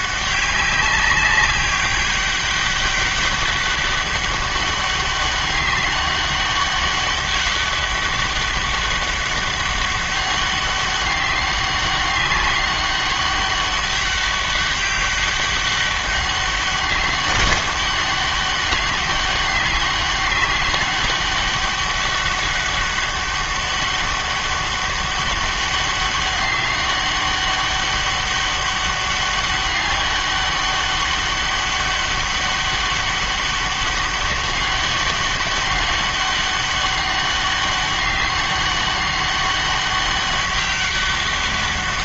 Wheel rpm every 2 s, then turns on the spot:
200, 200, 200, 200, 190, 200, 200, 200, 190, 200, 200, 200, 200, 200, 200, 200, 200, 200, 200, 200, 200.
none